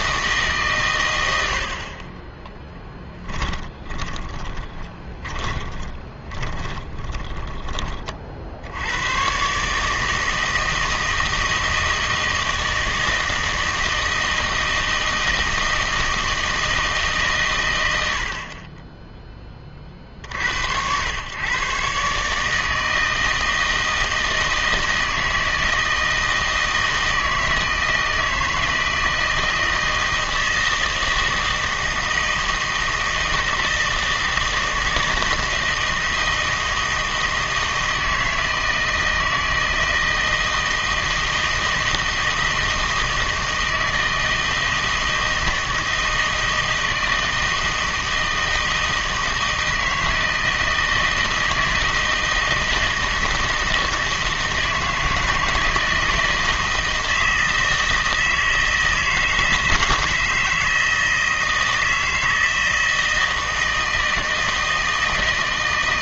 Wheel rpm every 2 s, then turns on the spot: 130, 10, 20, 20, 80, 160, 160, 160, 160, 20, 80, 160, 160, 160, 160, 160, 160, 160, 160, 160, 160, 160, 160, 160, 160, 160, 160, 160, 160, 160, 160, 160, 160.
2-8